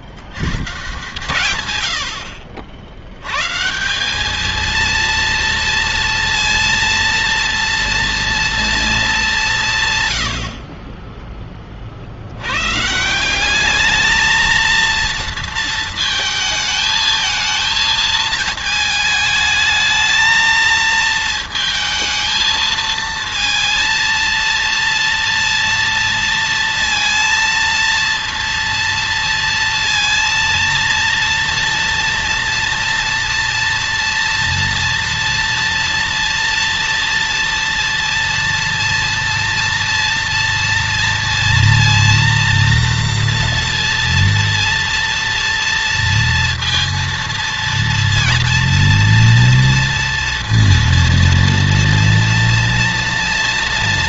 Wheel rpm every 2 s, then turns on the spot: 80, 60, 210, 230, 230, 70, 80, 220, 220, 220, 220, 220, 230, 230, 230, 230, 230, 230, 230, 230, 230, 240, 230, 230, 230, 230, 230.
none